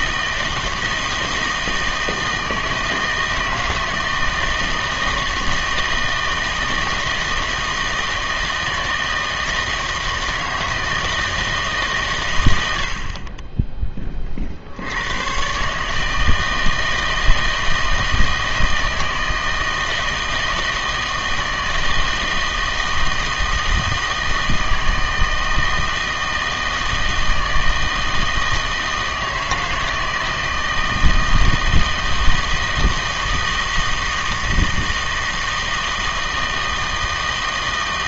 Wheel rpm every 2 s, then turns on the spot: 160, 160, 160, 160, 160, 160, 90, 70, 160, 160, 160, 160, 160, 160, 160, 160, 160, 160, 160.
none